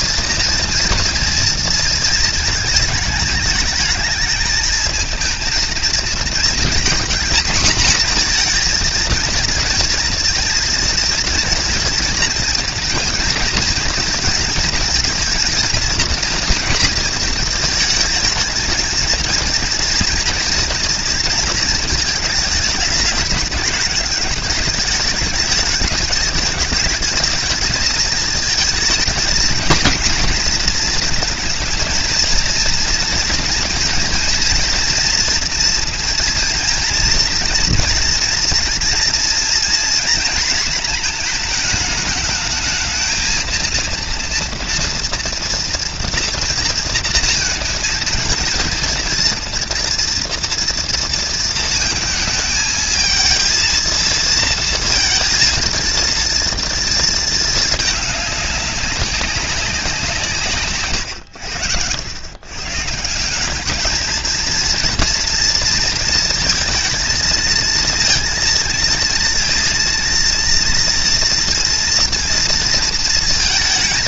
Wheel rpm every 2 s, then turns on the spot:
230, 220, 220, 230, 230, 240, 220, 230, 230, 220, 230, 210, 210, 220, 220, 230, 230, 230, 230, 230, 220, 220, 230, 230, 230, 230, 220, 230, 230, 210, 140, 130, 230, 230, 230, 230, 230.
none